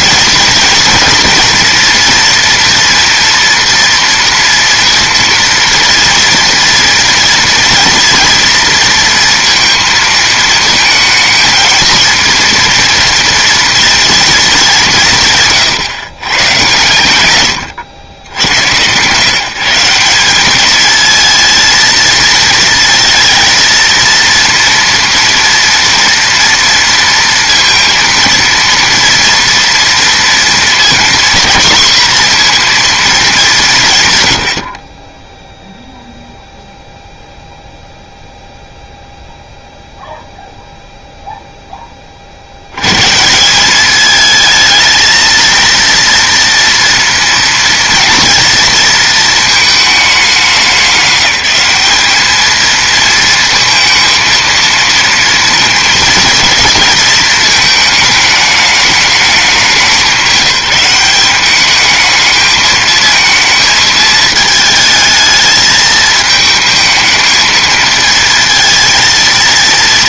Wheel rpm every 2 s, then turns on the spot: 230, 240, 240, 230, 230, 220, 230, 200, 120, 100, 210, 230, 230, 230, 230, 240, 240, 60, 0, 0, 0, 90, 220, 230, 230, 200, 220, 230, 230, 210, 190, 220, 220, 220, 230.
none